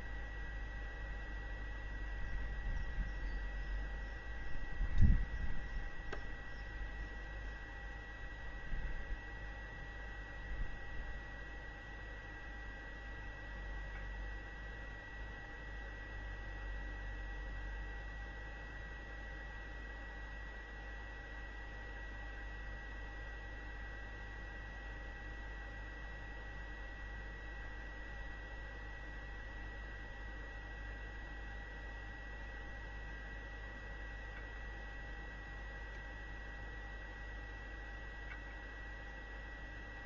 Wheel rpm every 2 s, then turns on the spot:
0, 0, 0, 0, 0, 0, 0, 0, 0, 0, 0, 0, 0, 0, 0, 0, 0, 0, 0, 0.
none